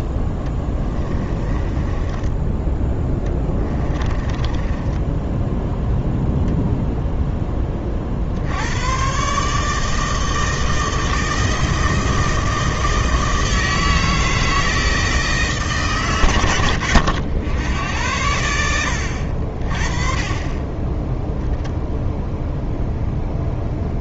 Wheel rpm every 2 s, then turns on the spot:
10, 20, 10, 0, 90, 160, 160, 160, 90, 70, 20, 0.
0-2 4-6